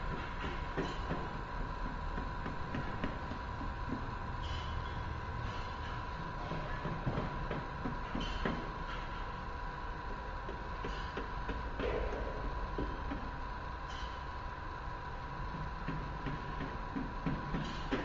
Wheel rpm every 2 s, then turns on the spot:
0, 0, 0, 0, 0, 0, 0, 0, 0.
none